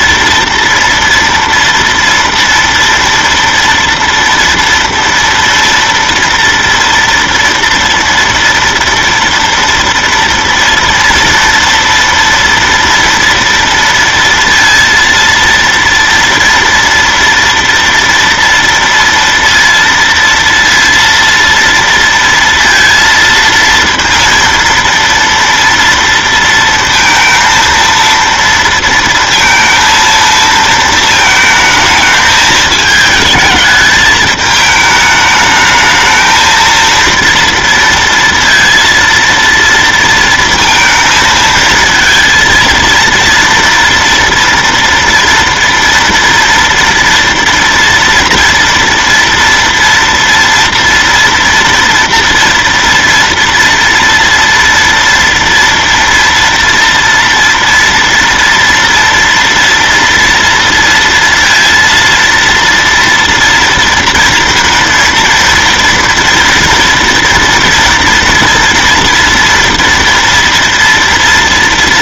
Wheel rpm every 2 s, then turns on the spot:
230, 230, 230, 240, 230, 230, 230, 230, 230, 230, 230, 230, 230, 230, 230, 230, 220, 210, 220, 230, 230, 230, 230, 230, 230, 230, 230, 230, 230, 230, 230, 230, 230, 230, 230, 230.
none